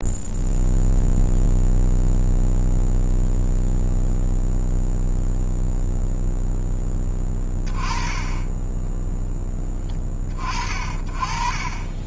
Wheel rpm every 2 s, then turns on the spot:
0, 0, 0, 20, 10, 50.
none